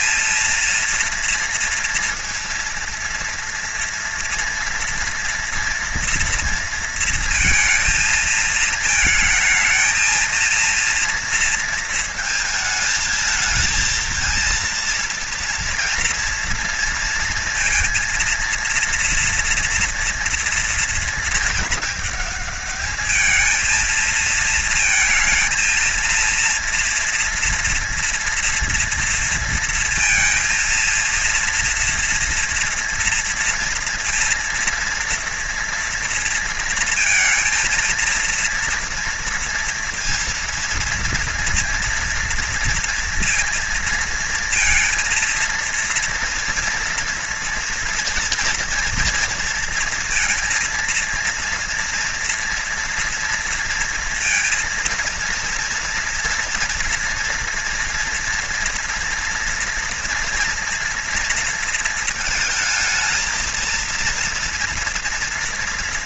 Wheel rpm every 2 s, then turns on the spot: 230, 230, 230, 230, 220, 230, 220, 230, 230, 230, 230, 210, 230, 230, 230, 230, 230, 230, 230, 230, 230, 230, 230, 230, 240, 230, 240, 230, 230, 230, 230, 220, 230.
none